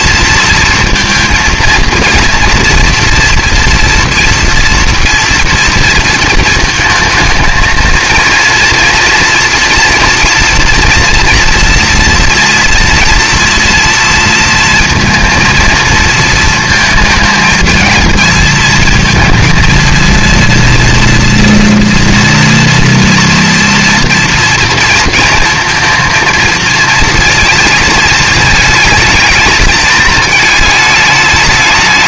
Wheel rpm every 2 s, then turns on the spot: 230, 230, 230, 220, 230, 230, 230, 230, 220, 220, 230, 240, 230, 230, 220, 220.
none